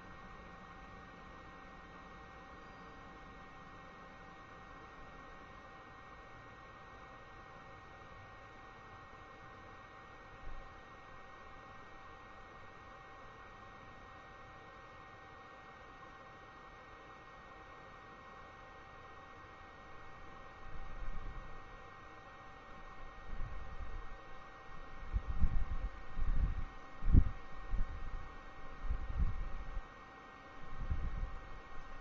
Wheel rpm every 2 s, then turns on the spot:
0, 0, 0, 0, 0, 0, 0, 0, 0, 0, 0, 0, 0, 0, 0, 0.
none